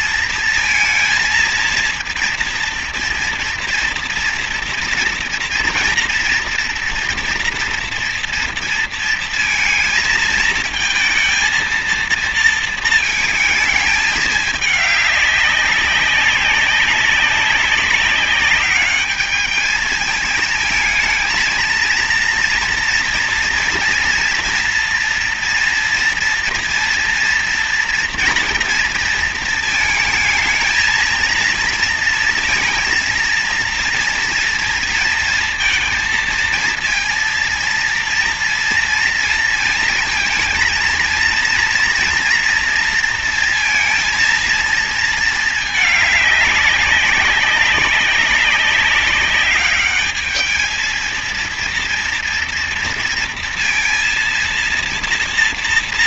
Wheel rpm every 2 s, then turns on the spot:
230, 230, 230, 230, 230, 220, 230, 210, 190, 200, 220, 240, 230, 230, 230, 220, 230, 230, 230, 230, 230, 230, 230, 190, 200, 220, 230, 230.
none